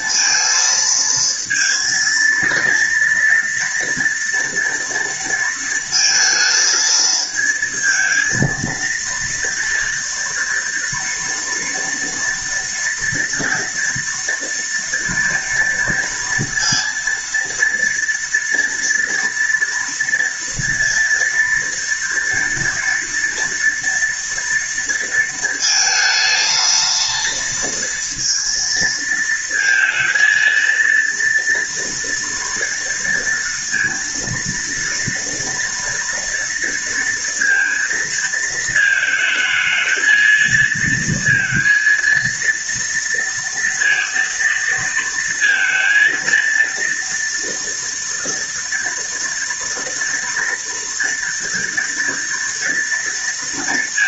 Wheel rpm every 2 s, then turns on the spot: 230, 230, 230, 220, 230, 230, 230, 230, 230, 230, 240, 230, 230, 230, 230, 230, 230, 230, 230, 220, 230, 230, 230, 230, 230, 230, 230.
none